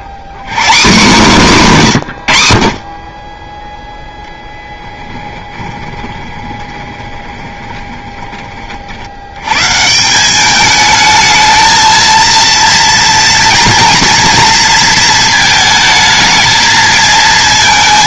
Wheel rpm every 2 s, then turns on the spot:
160, 70, 10, 20, 40, 210, 230, 230, 220.
4-8